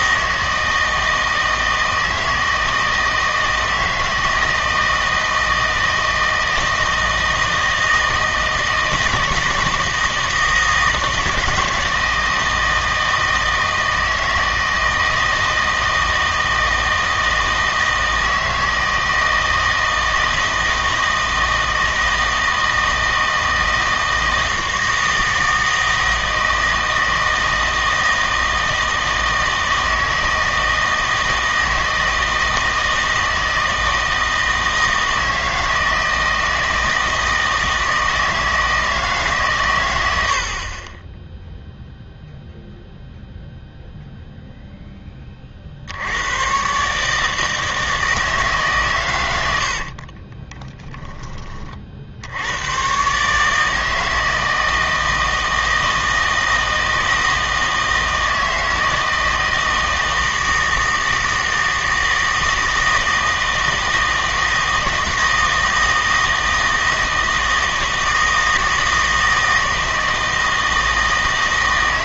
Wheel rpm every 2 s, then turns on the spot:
160, 160, 160, 160, 160, 160, 160, 160, 160, 160, 160, 160, 160, 160, 160, 160, 160, 160, 160, 160, 30, 0, 0, 130, 140, 10, 90, 160, 160, 160, 160, 160, 160, 160, 160, 160.
50-52